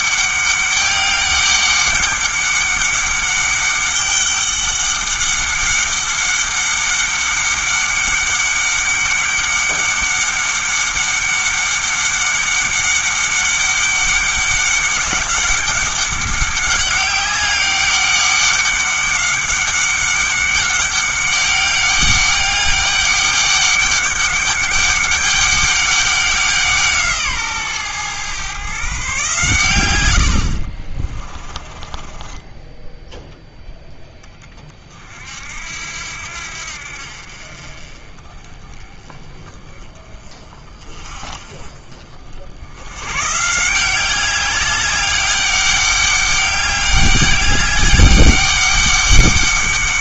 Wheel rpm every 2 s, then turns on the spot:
200, 200, 200, 200, 200, 200, 200, 200, 200, 200, 200, 200, 200, 170, 140, 40, 10, 40, 60, 20, 40, 90, 190, 200, 200.
30-34